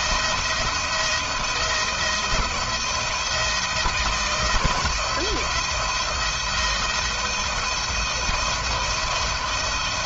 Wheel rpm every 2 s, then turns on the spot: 170, 170, 160, 160, 170.
none